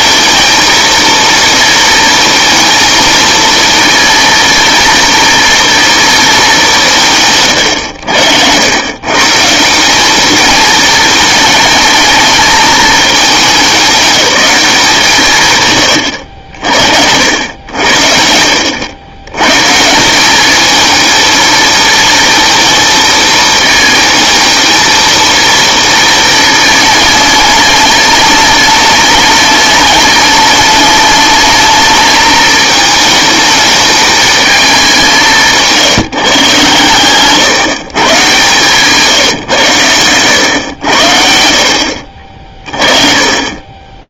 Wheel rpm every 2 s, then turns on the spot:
230, 220, 230, 200, 100, 220, 220, 190, 70, 80, 210, 220, 220, 220, 210, 210, 220, 200, 140, 140, 100, 40.
38-40